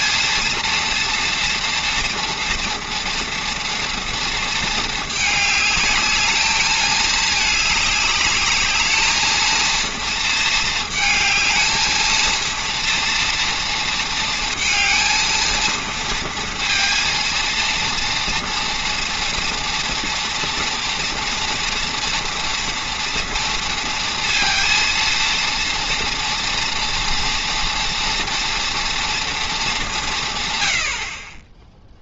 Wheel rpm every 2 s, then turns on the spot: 230, 230, 220, 220, 210, 220, 230, 230, 230, 230, 230, 240, 230, 230, 230, 100.
none